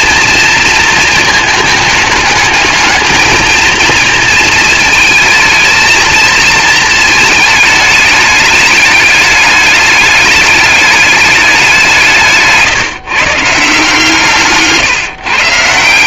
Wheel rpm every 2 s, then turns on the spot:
220, 210, 220, 220, 210, 210, 150, 140.
none